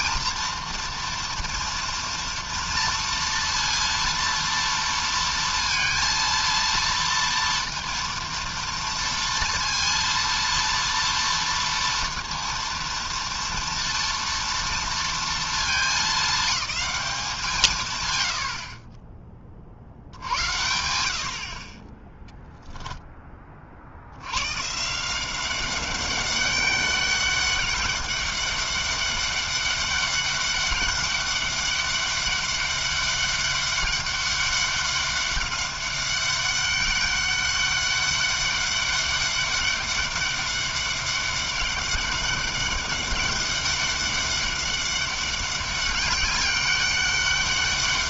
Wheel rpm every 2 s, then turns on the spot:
230, 230, 230, 230, 230, 230, 230, 230, 210, 80, 80, 0, 120, 200, 200, 200, 200, 200, 200, 200, 200, 200, 200, 200.
18-20